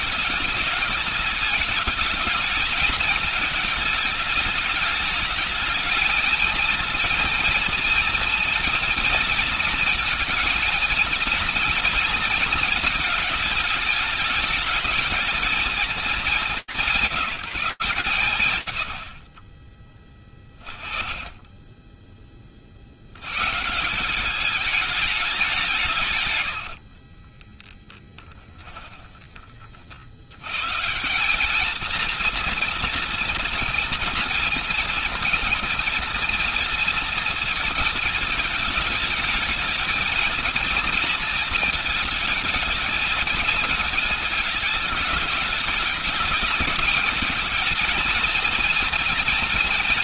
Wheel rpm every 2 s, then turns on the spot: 210, 220, 210, 230, 230, 230, 220, 210, 190, 100, 20, 70, 210, 50, 40, 210, 230, 230, 220, 220, 220, 220, 210, 230, 230.
26-28